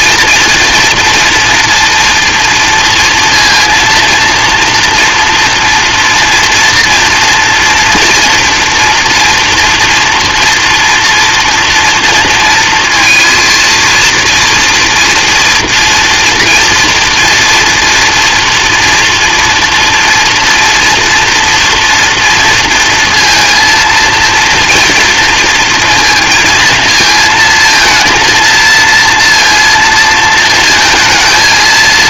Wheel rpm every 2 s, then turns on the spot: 230, 230, 230, 230, 230, 240, 230, 230, 230, 230, 230, 230, 230, 230, 230, 220.
none